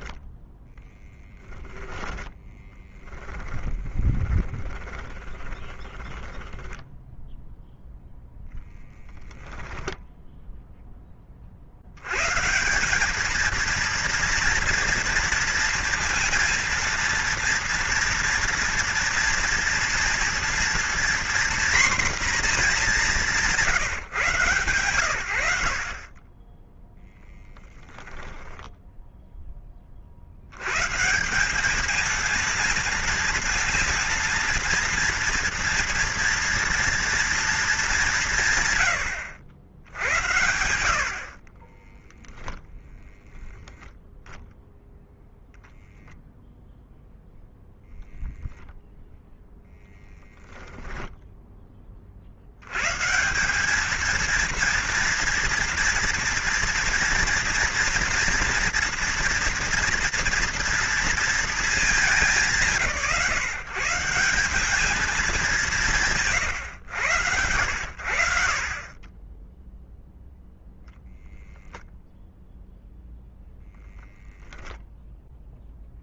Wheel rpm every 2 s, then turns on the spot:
10, 10, 20, 10, 0, 10, 190, 230, 230, 230, 240, 200, 120, 10, 10, 130, 230, 230, 230, 100, 100, 0, 0, 0, 0, 0, 120, 230, 230, 230, 230, 160, 210, 100, 30, 0, 0, 0.
0-8 28-30